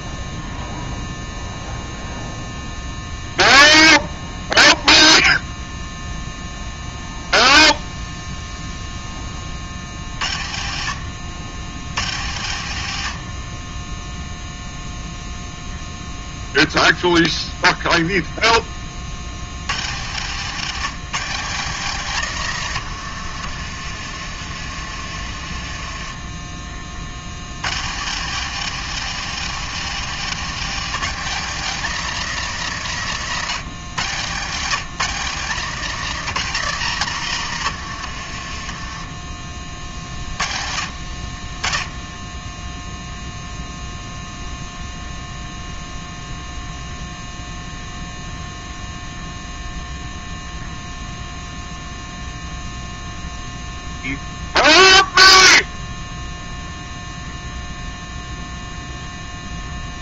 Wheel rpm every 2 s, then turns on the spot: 0, 0, 0, 0, 0, 70, 110, 0, 0, 10, 160, 150, 50, 30, 190, 200, 190, 140, 200, 60, 40, 0, 0, 0, 0, 0, 0, 0, 0, 0.
24-26 38-40